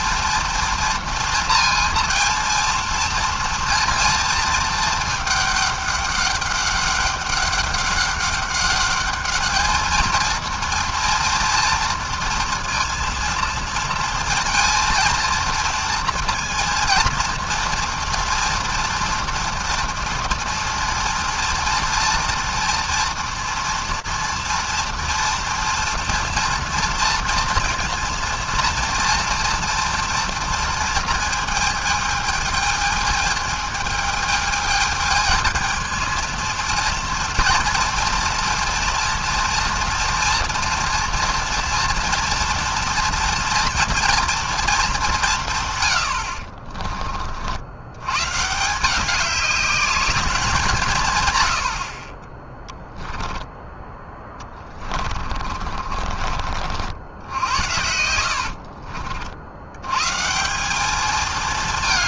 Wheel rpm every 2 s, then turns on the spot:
230, 230, 220, 200, 200, 230, 230, 230, 230, 230, 230, 230, 230, 230, 230, 230, 220, 220, 230, 230, 230, 230, 230, 50, 140, 190, 10, 20, 40, 70, 170.
54-56 58-60